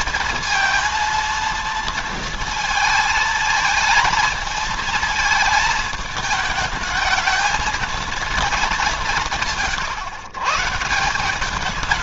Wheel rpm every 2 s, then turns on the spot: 230, 220, 230, 220, 200, 150.
none